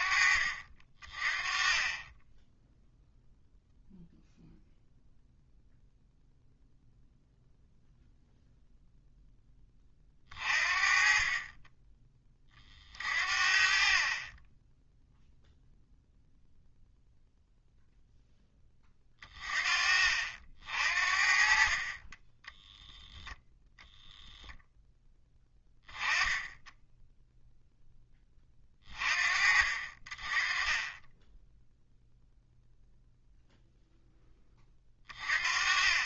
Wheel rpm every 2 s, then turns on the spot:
40, 0, 0, 0, 0, 40, 40, 10, 0, 20, 50, 0, 10, 10, 30, 20, 0, 30.
none